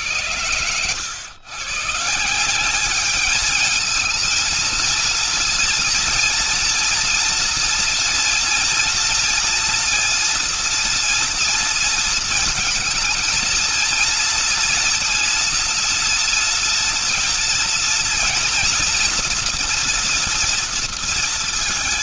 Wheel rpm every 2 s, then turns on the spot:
110, 180, 220, 230, 230, 230, 220, 230, 240, 240, 230.
none